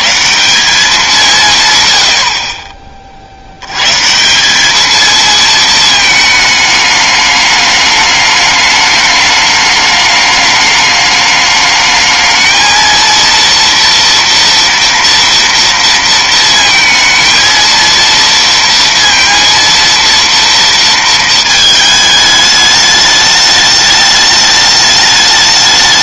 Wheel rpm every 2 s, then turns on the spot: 100, 100, 160, 220, 210, 210, 220, 240, 230, 230, 230, 210, 210.
none